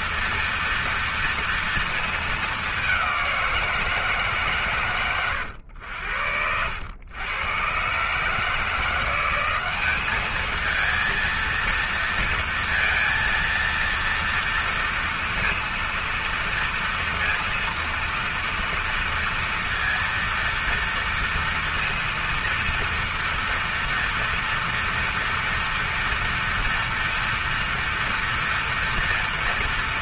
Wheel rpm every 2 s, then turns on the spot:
230, 210, 140, 90, 170, 220, 230, 230, 230, 230, 230, 230, 230, 230, 230.
none